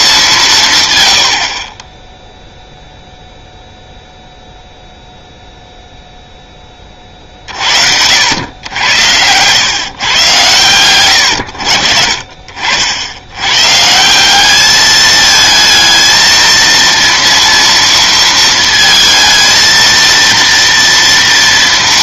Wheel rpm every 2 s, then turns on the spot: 150, 0, 0, 20, 100, 120, 60, 210, 230, 230, 230.
none